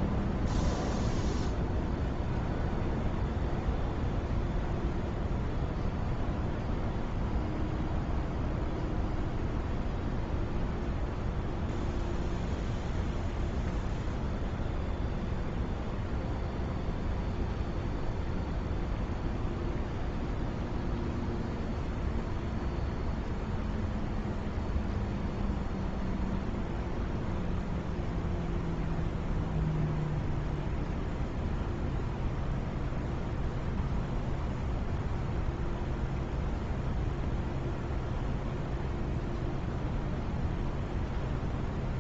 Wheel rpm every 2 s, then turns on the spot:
0, 0, 0, 0, 0, 0, 0, 0, 0, 0, 0, 0, 0, 0, 0, 0, 0, 0, 0, 0, 0.
none